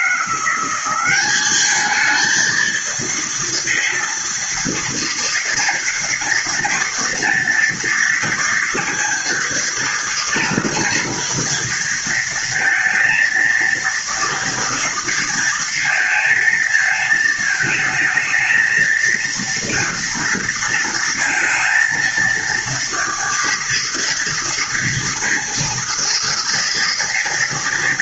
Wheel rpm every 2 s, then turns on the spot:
190, 230, 230, 230, 230, 230, 230, 230, 220, 230, 230, 230, 230, 230.
none